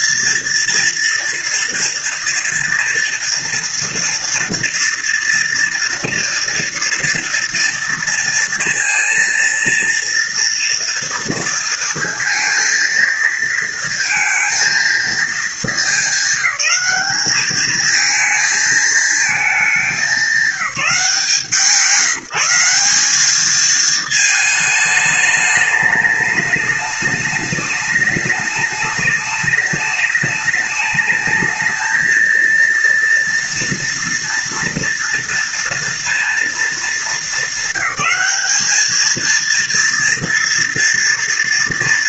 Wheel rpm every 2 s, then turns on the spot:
230, 230, 230, 240, 230, 230, 230, 230, 210, 220, 190, 170, 220, 210, 210, 210, 230, 230, 230, 210, 240.
none